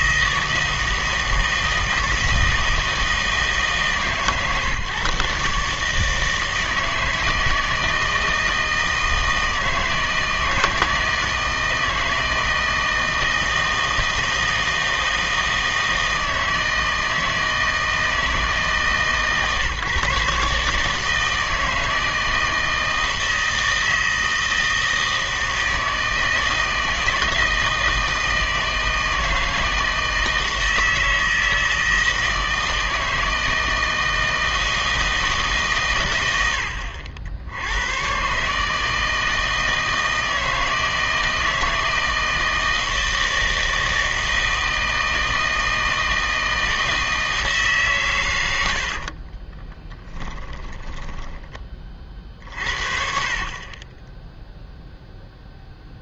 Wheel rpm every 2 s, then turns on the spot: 160, 160, 140, 160, 160, 160, 160, 160, 160, 160, 150, 160, 160, 160, 160, 160, 160, 160, 90, 150, 160, 160, 160, 160, 90, 10, 60, 0.
48-52